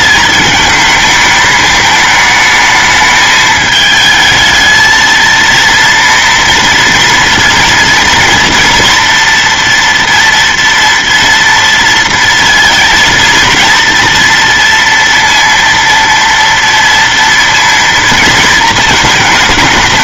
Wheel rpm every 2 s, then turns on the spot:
220, 220, 220, 230, 230, 230, 230, 230, 230, 230.
none